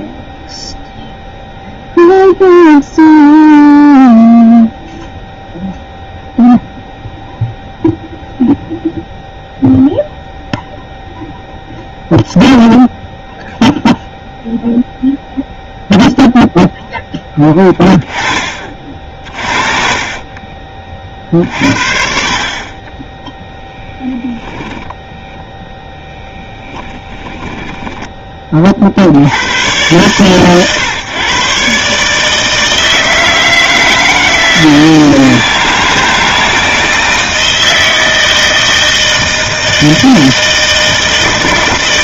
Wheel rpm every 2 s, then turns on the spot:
0, 0, 0, 0, 0, 0, 0, 0, 0, 30, 30, 30, 10, 10, 40, 130, 160, 160, 160, 160, 160.
26-28